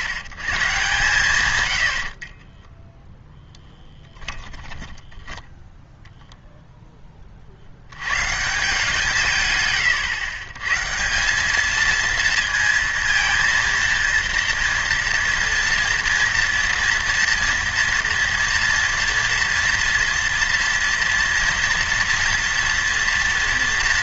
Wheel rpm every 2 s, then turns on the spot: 140, 20, 10, 0, 160, 120, 230, 230, 230, 230, 230, 230.
2-6